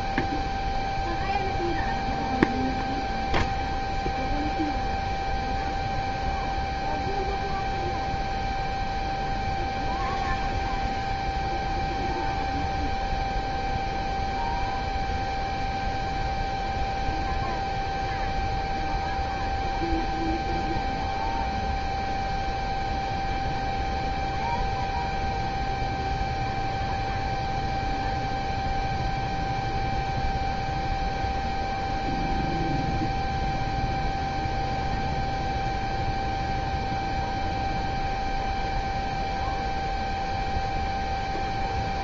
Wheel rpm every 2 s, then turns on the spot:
0, 0, 0, 0, 0, 0, 0, 0, 0, 0, 0, 0, 0, 0, 0, 0, 0, 0, 0, 0, 0.
none